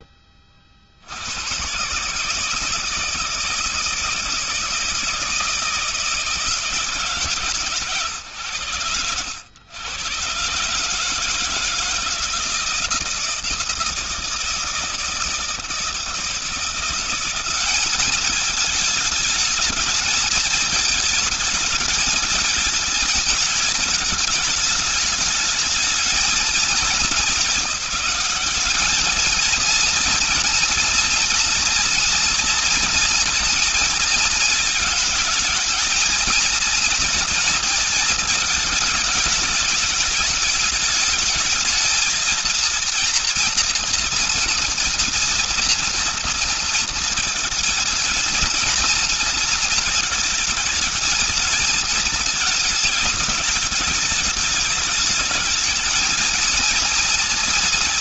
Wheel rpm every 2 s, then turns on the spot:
50, 160, 160, 140, 90, 140, 160, 160, 180, 220, 220, 220, 220, 200, 200, 230, 230, 210, 230, 210, 220, 230, 230, 230, 220, 220, 210, 220, 230.
none